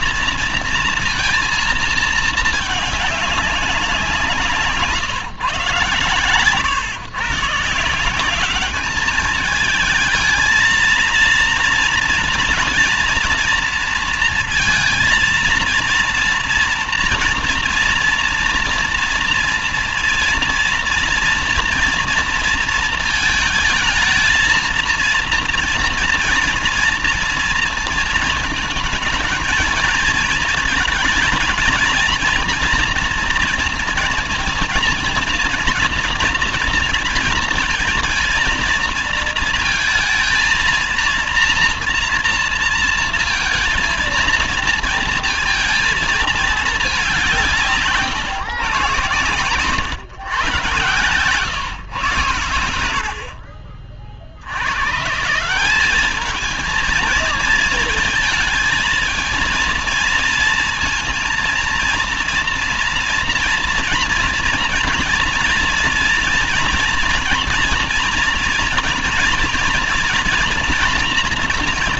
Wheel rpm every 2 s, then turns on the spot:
230, 220, 170, 130, 200, 220, 230, 230, 230, 230, 230, 230, 220, 230, 220, 220, 230, 230, 230, 220, 230, 230, 230, 210, 130, 120, 80, 120, 220, 230, 230, 230, 230, 230, 230, 240.
none